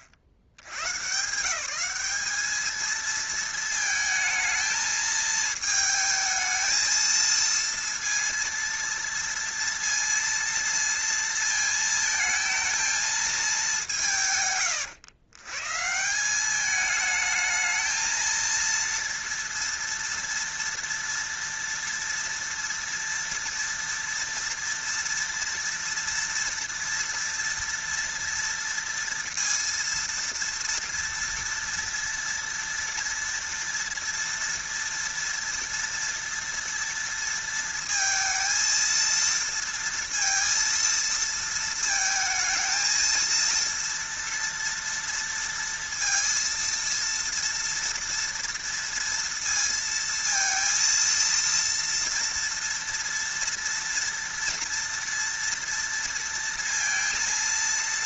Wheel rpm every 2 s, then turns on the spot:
70, 220, 220, 220, 230, 230, 220, 120, 210, 230, 230, 230, 230, 230, 230, 230, 230, 230, 230, 230, 230, 220, 230, 230, 230, 230, 230, 230, 230.
none